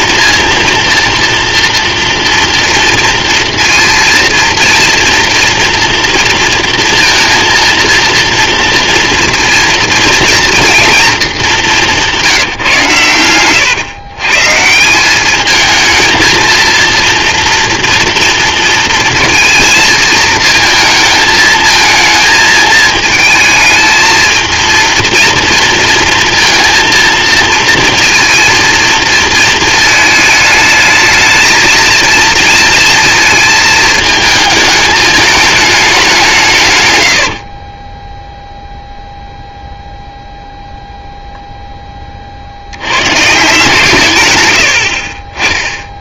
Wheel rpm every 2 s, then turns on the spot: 230, 230, 230, 230, 230, 230, 140, 170, 230, 230, 220, 220, 230, 230, 230, 220, 230, 220, 140, 0, 0, 80, 70.
44-46